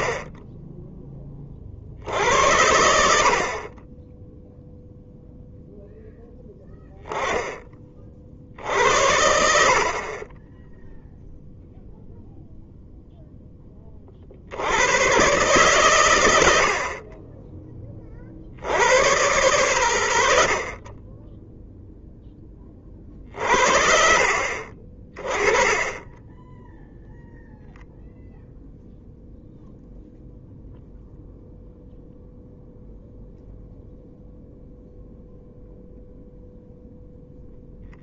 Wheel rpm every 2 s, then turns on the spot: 10, 80, 0, 10, 70, 10, 0, 90, 80, 70, 50, 30, 40, 0, 0, 0, 0, 0, 0.
none